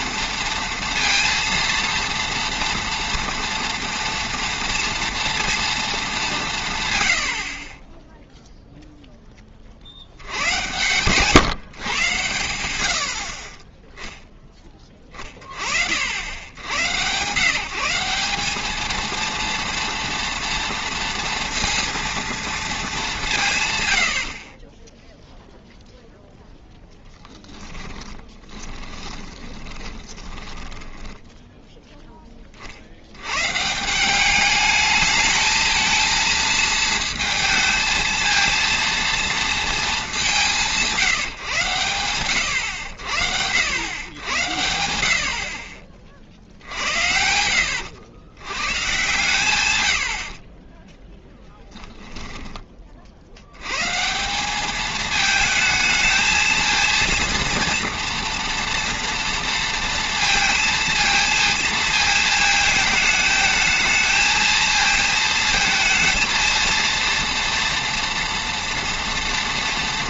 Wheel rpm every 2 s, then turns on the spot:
230, 230, 230, 150, 0, 120, 90, 20, 100, 210, 230, 220, 20, 0, 20, 20, 40, 210, 230, 230, 180, 90, 90, 60, 120, 10, 20, 200, 230, 230, 230, 220, 230, 230, 230.
24-26 28-32 50-52